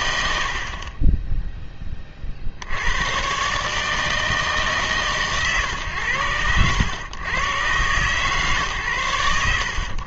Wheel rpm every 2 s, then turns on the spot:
50, 80, 150, 100, 120.
0-2